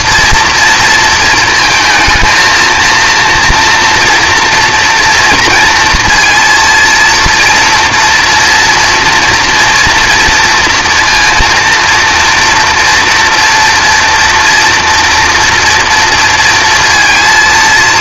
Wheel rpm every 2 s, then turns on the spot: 230, 230, 230, 230, 230, 230, 240, 230, 230.
none